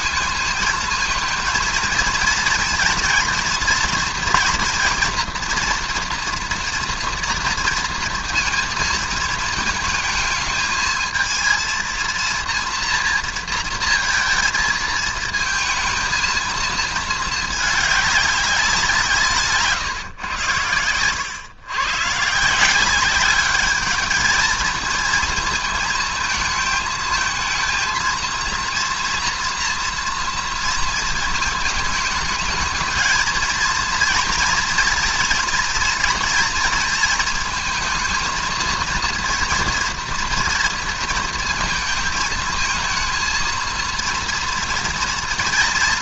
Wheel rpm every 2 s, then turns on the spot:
220, 230, 230, 240, 230, 220, 230, 220, 220, 190, 100, 170, 220, 220, 230, 230, 220, 230, 230, 230, 230, 220, 230.
none